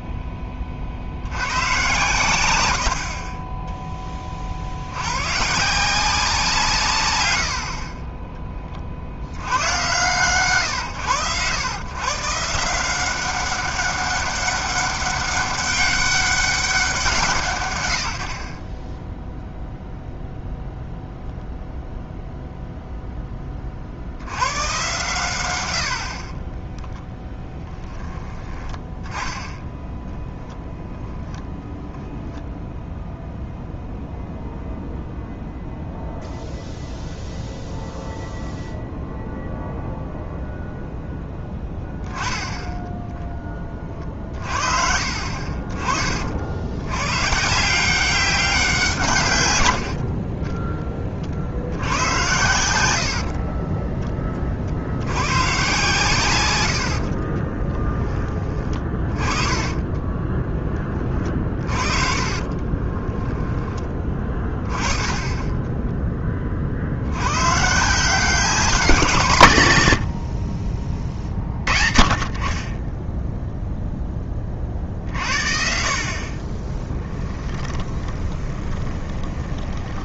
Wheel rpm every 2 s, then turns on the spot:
40, 90, 70, 150, 40, 120, 170, 200, 190, 30, 0, 0, 110, 10, 10, 10, 10, 0, 0, 0, 0, 10, 50, 90, 180, 20, 90, 60, 80, 30, 30, 20, 20, 60, 180, 40, 30, 40, 20, 20.
26-28 32-34 56-60 62-64 70-72 76-80